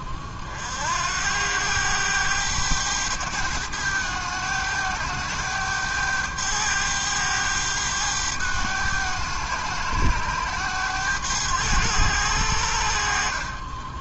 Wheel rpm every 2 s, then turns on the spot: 40, 100, 100, 100, 100, 100, 80.
none